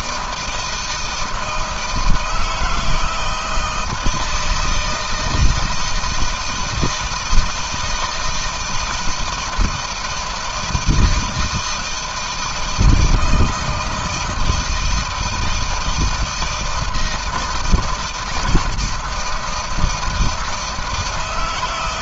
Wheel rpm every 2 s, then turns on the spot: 160, 160, 160, 160, 160, 170, 160, 160, 160, 160, 160.
none